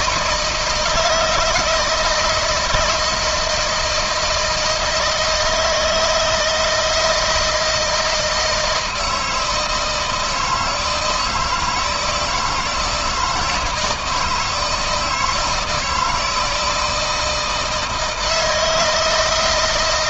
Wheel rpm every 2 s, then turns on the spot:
160, 170, 160, 160, 160, 160, 160, 160, 160, 160.
none